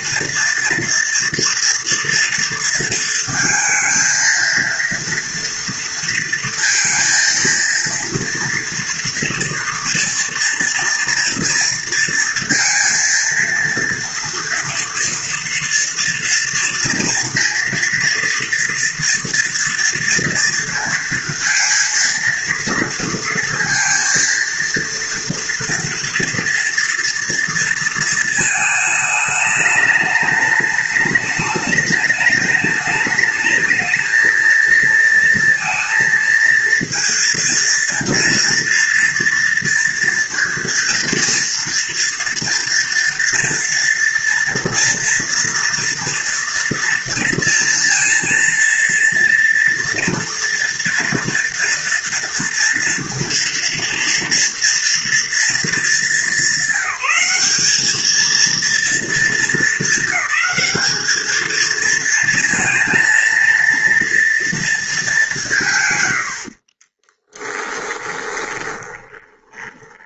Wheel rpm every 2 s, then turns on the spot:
240, 230, 230, 230, 240, 240, 230, 230, 230, 230, 230, 230, 230, 230, 220, 210, 210, 230, 230, 230, 230, 230, 230, 230, 230, 230, 230, 230, 210, 230, 220, 230, 220, 20, 20.
66-70